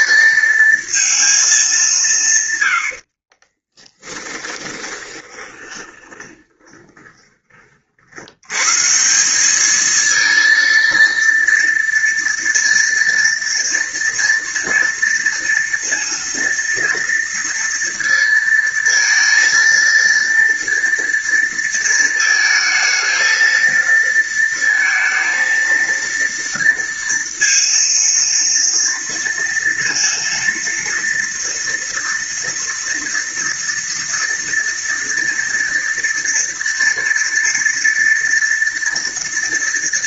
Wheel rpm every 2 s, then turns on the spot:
230, 100, 10, 20, 130, 230, 230, 230, 230, 230, 230, 220, 230, 230, 230, 230, 240, 230, 240, 230.
4-8